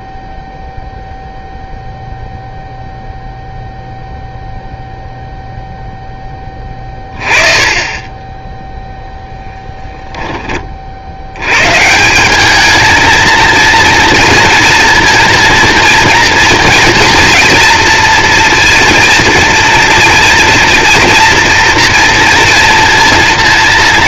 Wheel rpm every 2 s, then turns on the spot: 0, 0, 0, 20, 0, 40, 220, 230, 230, 230, 240, 230.
none